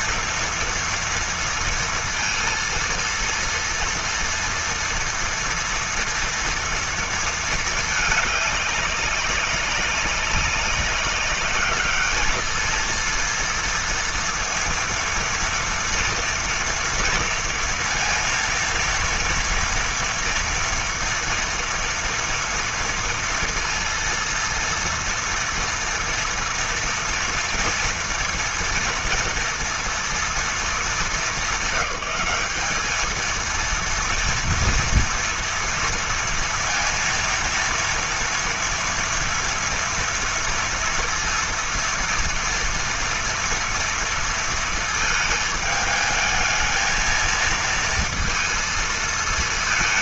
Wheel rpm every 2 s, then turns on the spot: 230, 230, 230, 230, 200, 200, 230, 230, 230, 230, 230, 230, 230, 230, 230, 210, 210, 230, 230, 230, 230, 230, 220, 220, 220.
none